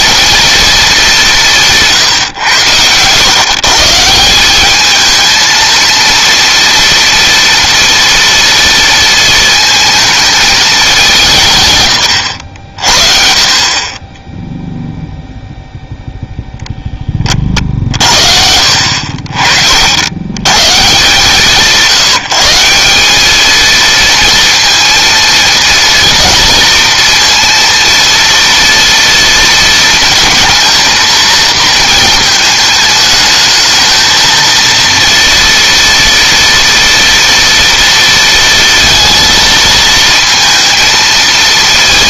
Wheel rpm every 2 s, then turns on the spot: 210, 110, 220, 230, 230, 190, 60, 0, 10, 60, 170, 200, 230, 230, 230, 230, 210, 230, 230, 230, 230.
none